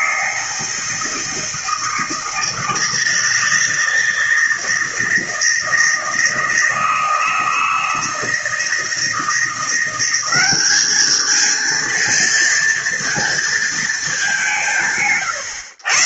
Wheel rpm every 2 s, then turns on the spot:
160, 160, 160, 160, 170, 220, 230, 140.
none